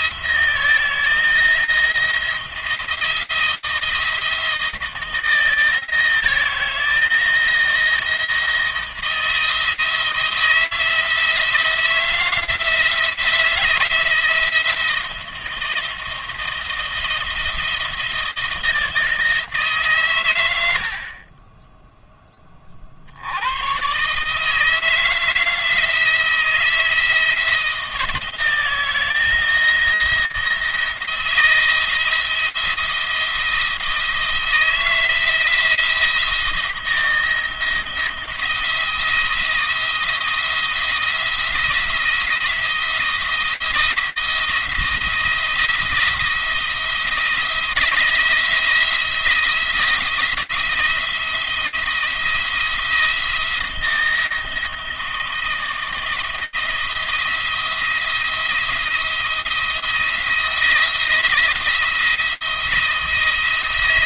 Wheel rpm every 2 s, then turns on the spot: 170, 170, 160, 160, 170, 160, 160, 160, 170, 160, 60, 50, 160, 160, 170, 170, 170, 160, 170, 170, 170, 170, 170, 170, 170, 170, 170, 160, 170, 170, 160, 160.
none